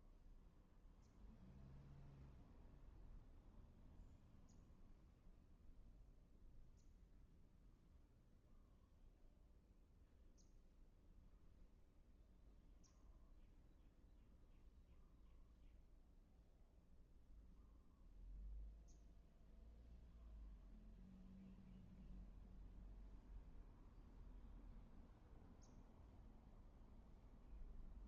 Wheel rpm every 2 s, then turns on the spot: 0, 0, 0, 0, 0, 0, 0, 0, 0, 0, 0, 0, 0, 0.
none